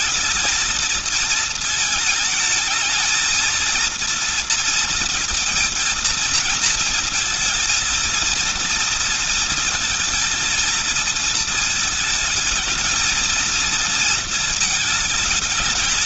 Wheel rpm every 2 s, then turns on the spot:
220, 220, 230, 220, 230, 230, 220, 220.
none